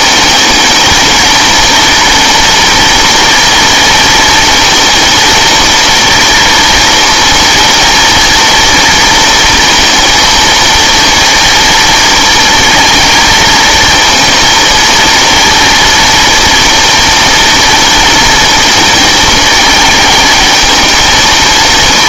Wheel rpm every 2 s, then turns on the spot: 210, 240, 230, 230, 230, 230, 230, 230, 230, 230, 220.
none